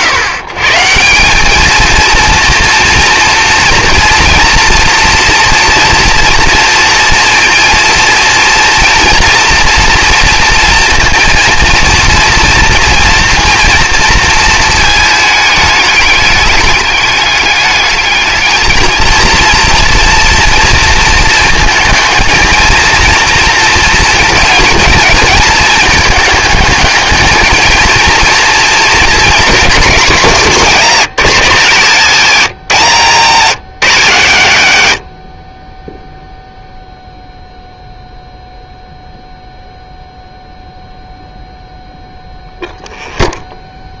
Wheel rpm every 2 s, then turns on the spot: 140, 230, 230, 230, 230, 230, 230, 220, 210, 220, 230, 230, 220, 210, 230, 190, 180, 130, 0, 0, 0, 0.
none